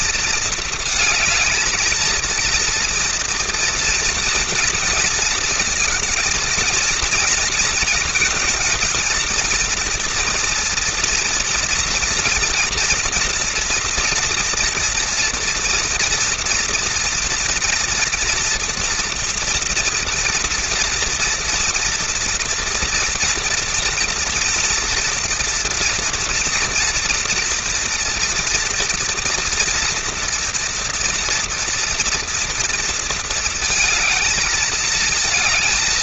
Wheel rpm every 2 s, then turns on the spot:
230, 240, 230, 230, 220, 230, 230, 230, 230, 240, 240, 230, 230, 240, 230, 230, 230, 220.
none